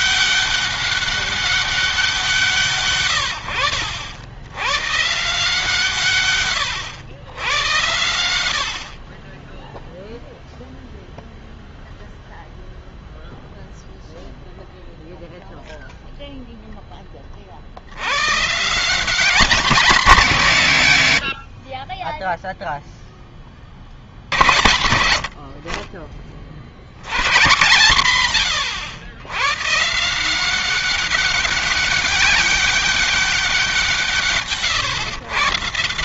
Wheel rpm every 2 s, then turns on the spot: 200, 160, 100, 120, 90, 0, 0, 0, 0, 130, 190, 10, 60, 40, 140, 180, 200, 150.
none